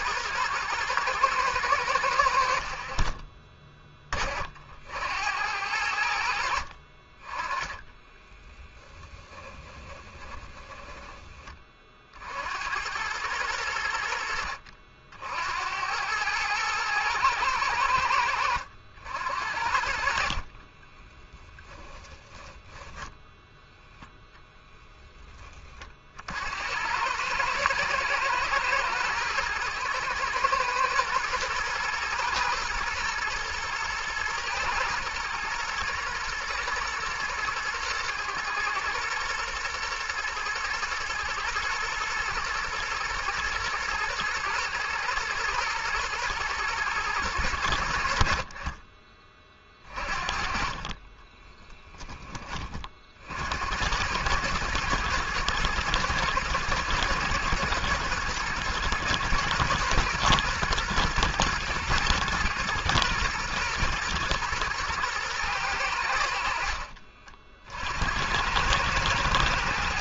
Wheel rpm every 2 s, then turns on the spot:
110, 50, 70, 60, 10, 20, 80, 60, 110, 80, 30, 10, 10, 80, 110, 110, 110, 110, 120, 110, 110, 110, 110, 110, 40, 40, 30, 110, 110, 110, 120, 120, 120, 60, 100.
8-12 20-22 50-52